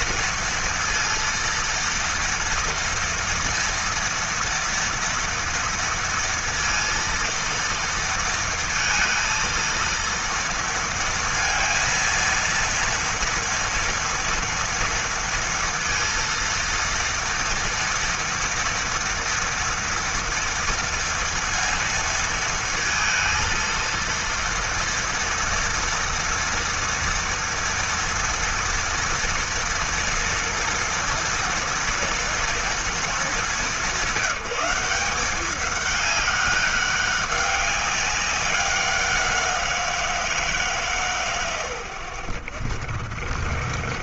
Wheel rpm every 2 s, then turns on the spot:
230, 230, 230, 230, 230, 230, 230, 230, 230, 230, 230, 230, 230, 230, 230, 230, 210, 190, 200, 180, 130, 60.
none